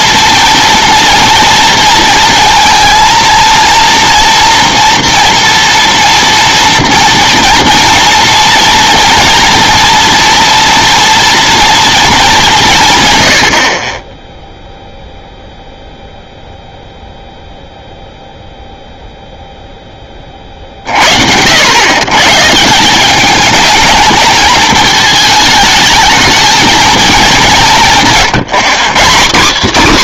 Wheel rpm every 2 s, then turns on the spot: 230, 220, 230, 240, 230, 240, 170, 0, 0, 0, 40, 170, 220, 230, 180.
none